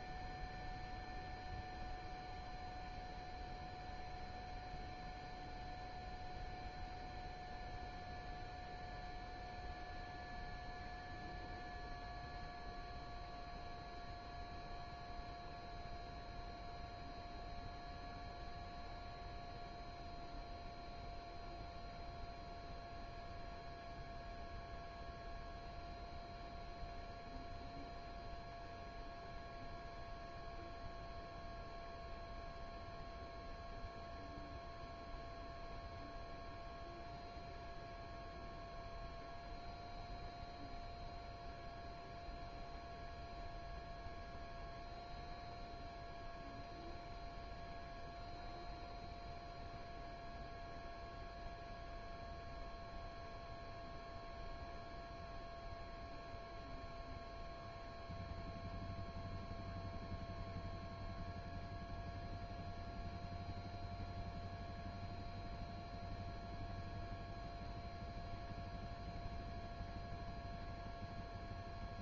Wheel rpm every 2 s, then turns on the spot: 0, 0, 0, 0, 0, 0, 0, 0, 0, 0, 0, 0, 0, 0, 0, 0, 0, 0, 0, 0, 0, 0, 0, 0, 0, 0, 0, 0, 0, 0, 0, 0, 0, 0, 0, 0.
none